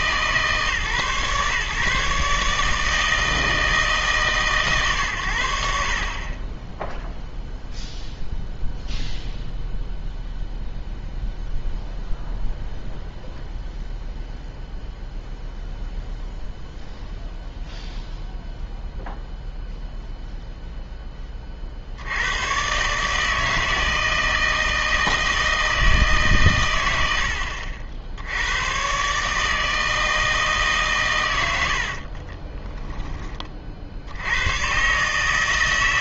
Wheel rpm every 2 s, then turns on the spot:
130, 150, 130, 10, 0, 0, 0, 0, 0, 0, 0, 130, 160, 120, 100, 150, 20, 120.
32-34